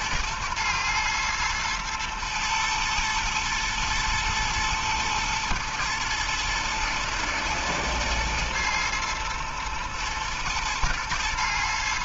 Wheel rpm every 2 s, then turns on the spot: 110, 120, 110, 120, 110, 120.
none